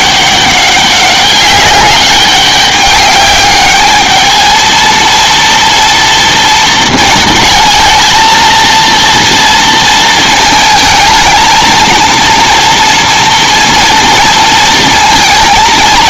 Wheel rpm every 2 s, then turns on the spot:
200, 200, 220, 230, 230, 220, 230, 230.
none